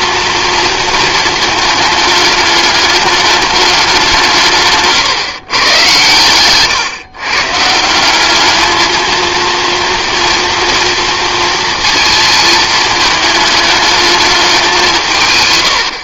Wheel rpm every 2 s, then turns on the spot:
230, 210, 150, 130, 220, 230, 220, 180.
none